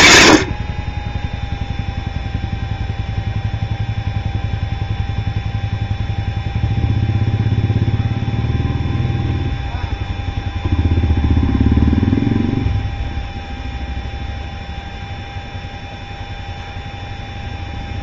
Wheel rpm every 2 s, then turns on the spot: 30, 0, 0, 0, 0, 0, 0, 0, 0.
none